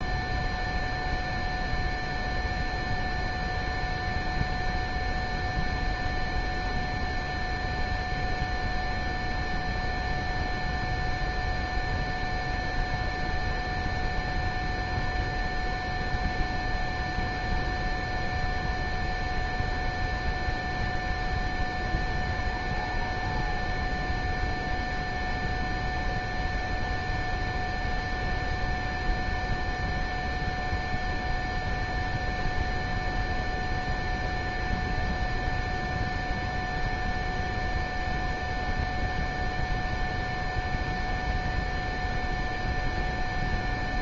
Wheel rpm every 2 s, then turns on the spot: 0, 0, 0, 0, 0, 0, 0, 0, 0, 0, 0, 0, 0, 0, 0, 0, 0, 0, 0, 0, 0, 0.
none